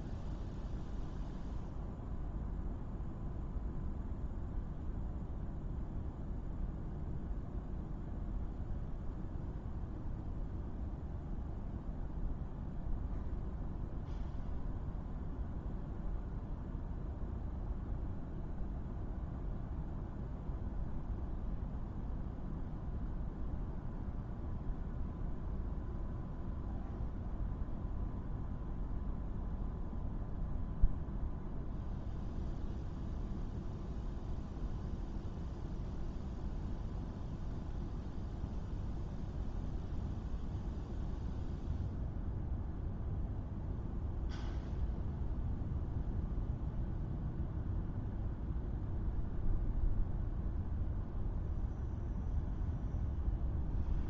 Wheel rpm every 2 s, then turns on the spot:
0, 0, 0, 0, 0, 0, 0, 0, 0, 0, 0, 0, 0, 0, 0, 0, 0, 0, 0, 0, 0, 0, 0, 0, 0, 0, 0.
none